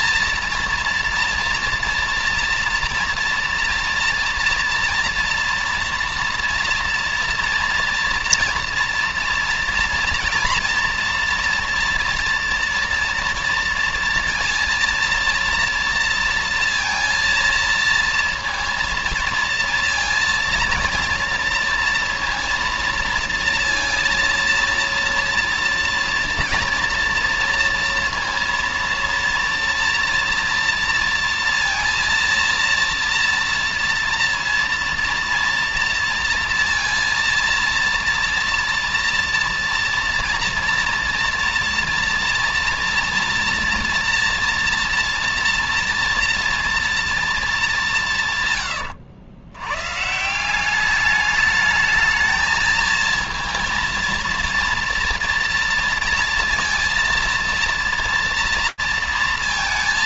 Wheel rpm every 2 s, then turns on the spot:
230, 230, 240, 230, 230, 230, 230, 230, 230, 230, 230, 230, 230, 230, 230, 230, 230, 230, 230, 230, 230, 240, 230, 230, 130, 170, 220, 230, 230, 230.
none